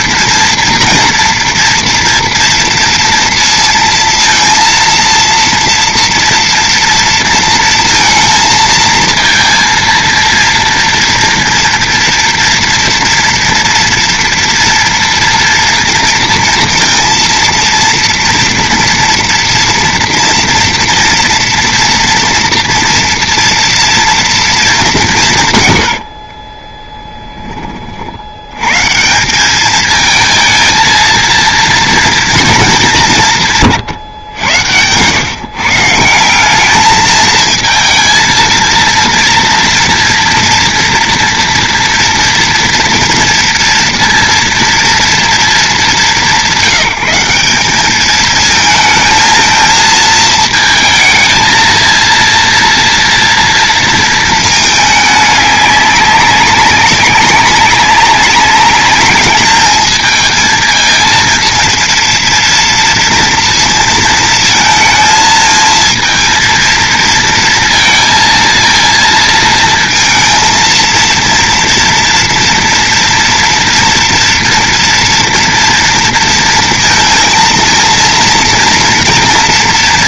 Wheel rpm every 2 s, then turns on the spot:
230, 230, 230, 230, 230, 230, 230, 230, 230, 230, 230, 240, 220, 40, 120, 220, 210, 110, 200, 230, 230, 230, 230, 190, 220, 220, 230, 220, 200, 200, 220, 230, 220, 230, 230, 230, 230, 230, 230, 230.
26-28